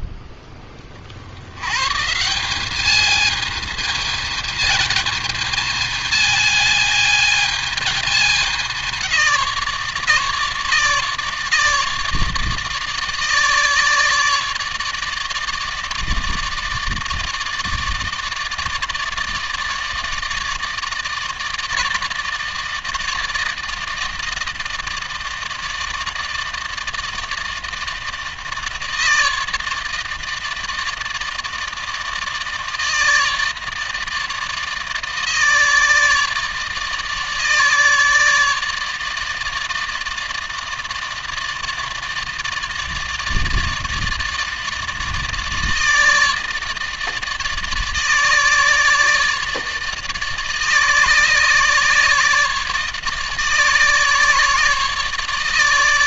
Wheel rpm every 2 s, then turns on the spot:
30, 200, 220, 220, 190, 150, 150, 150, 160, 160, 160, 160, 160, 160, 160, 160, 150, 160, 160, 160, 160, 160, 160, 150, 150, 150, 150, 150.
none